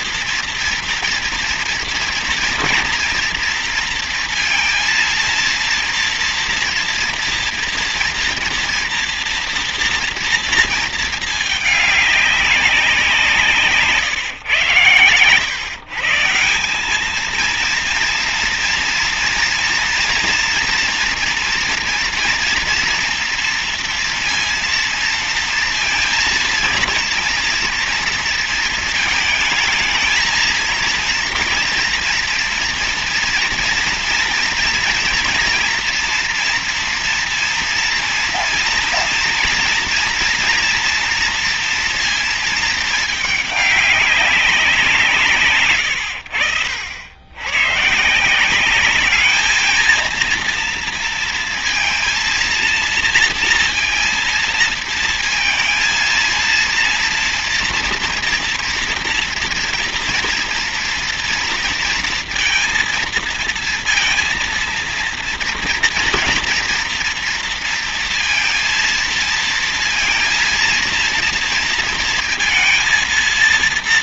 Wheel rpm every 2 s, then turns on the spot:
230, 230, 230, 230, 230, 230, 200, 130, 170, 230, 240, 230, 230, 230, 230, 230, 230, 230, 230, 230, 230, 220, 190, 80, 180, 230, 230, 230, 230, 230, 230, 230, 230, 230, 230, 230, 230.
none